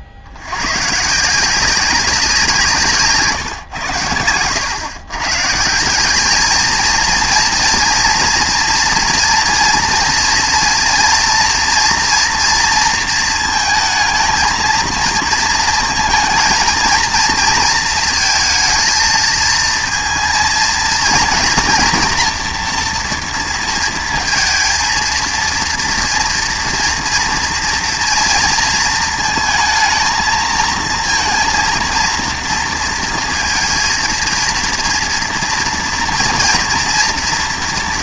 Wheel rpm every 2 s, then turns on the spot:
120, 160, 110, 220, 230, 230, 230, 230, 230, 220, 230, 230, 230, 230, 230, 230, 230, 230, 240.
none